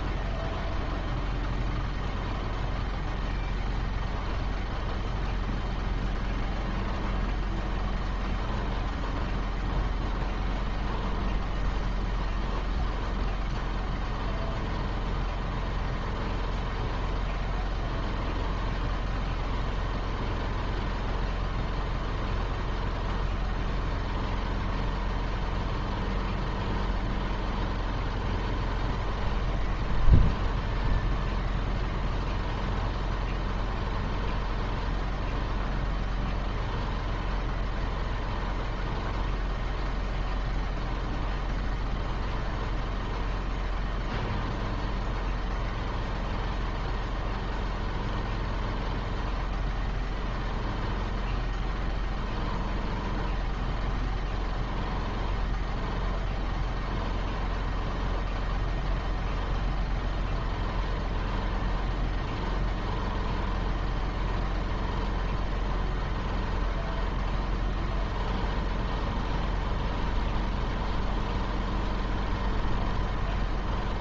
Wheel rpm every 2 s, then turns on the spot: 0, 0, 0, 0, 0, 0, 0, 0, 0, 0, 0, 0, 0, 0, 0, 0, 0, 0, 0, 0, 0, 0, 0, 0, 0, 0, 0, 0, 0, 0, 0, 0, 0, 0, 0, 0, 0.
none